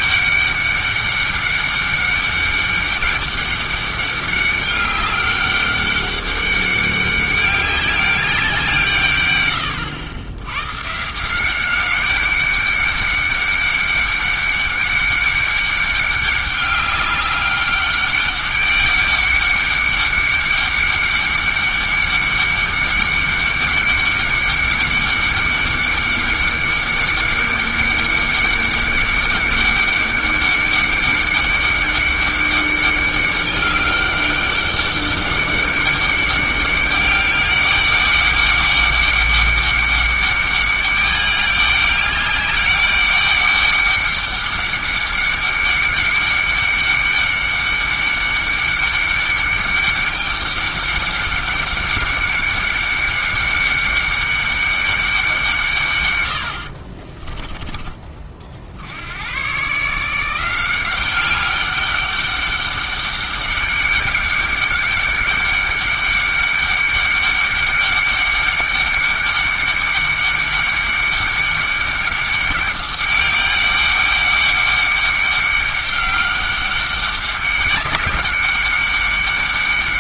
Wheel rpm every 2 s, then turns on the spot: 200, 200, 200, 200, 160, 120, 200, 200, 200, 200, 200, 200, 200, 200, 200, 200, 200, 200, 200, 200, 200, 200, 200, 200, 200, 200, 200, 200, 50, 60, 180, 200, 200, 200, 200, 200, 200, 200, 200, 200.
56-58